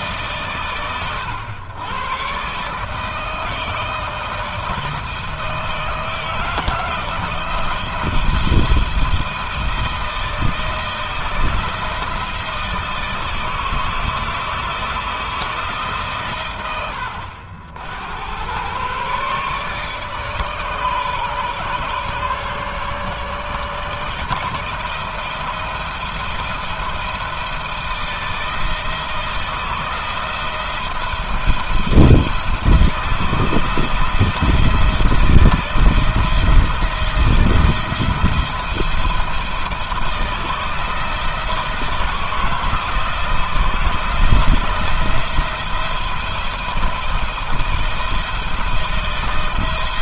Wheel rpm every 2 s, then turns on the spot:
120, 150, 160, 170, 170, 160, 160, 160, 90, 130, 140, 150, 170, 170, 160, 160, 160, 170, 170, 170, 160, 160, 170, 170, 170.
none